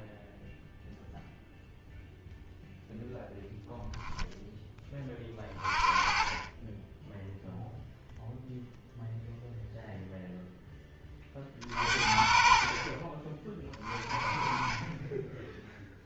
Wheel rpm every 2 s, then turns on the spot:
0, 0, 10, 10, 0, 10, 40, 20.
none